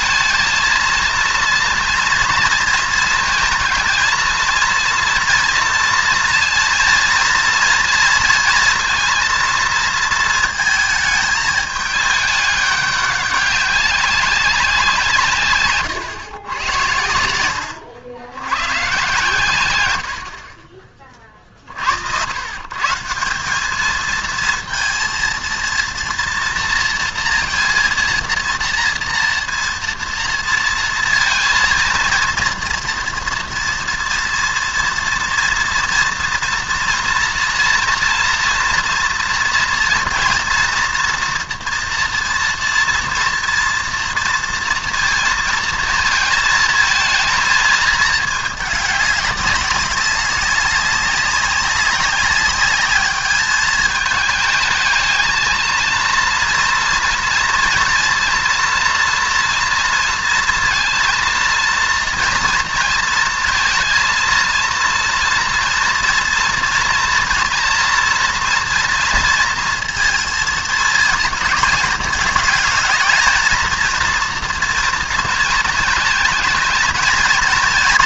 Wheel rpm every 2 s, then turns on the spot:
220, 230, 230, 230, 230, 220, 200, 190, 100, 120, 40, 130, 230, 230, 230, 230, 230, 230, 240, 230, 230, 230, 230, 220, 210, 200, 210, 220, 230, 240, 230, 230, 230, 230, 230, 220, 220, 230, 220.
none